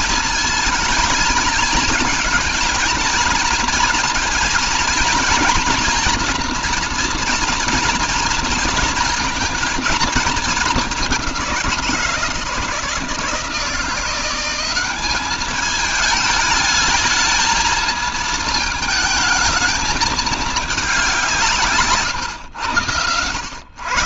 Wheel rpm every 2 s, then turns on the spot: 230, 230, 230, 240, 230, 200, 160, 190, 220, 210, 200, 110.
none